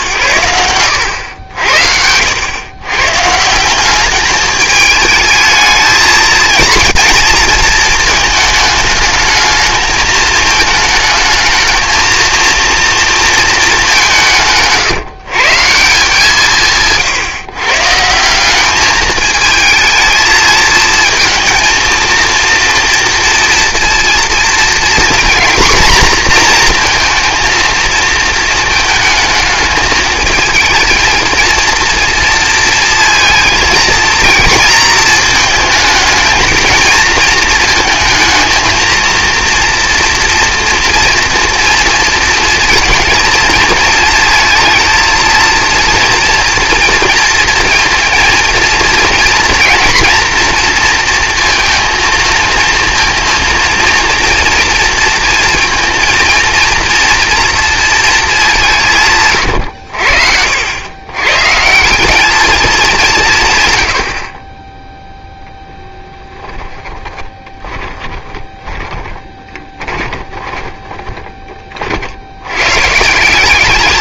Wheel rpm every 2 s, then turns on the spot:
90, 110, 210, 230, 220, 220, 230, 150, 160, 200, 220, 230, 230, 230, 220, 230, 230, 230, 230, 220, 230, 220, 230, 230, 230, 230, 230, 230, 230, 180, 90, 210, 20, 10, 20, 20, 110.
66-72